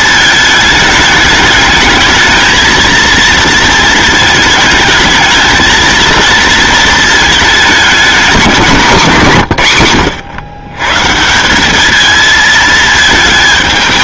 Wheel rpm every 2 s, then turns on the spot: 210, 230, 220, 220, 190, 130, 220.
none